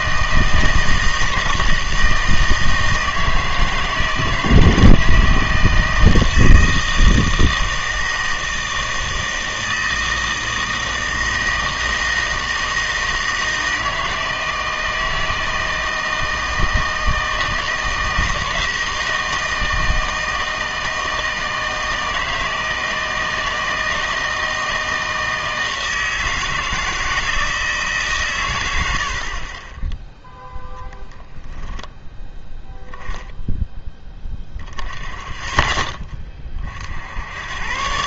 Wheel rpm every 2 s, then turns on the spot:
160, 160, 160, 160, 160, 160, 160, 160, 160, 170, 160, 160, 160, 160, 90, 0, 0, 10, 50.
none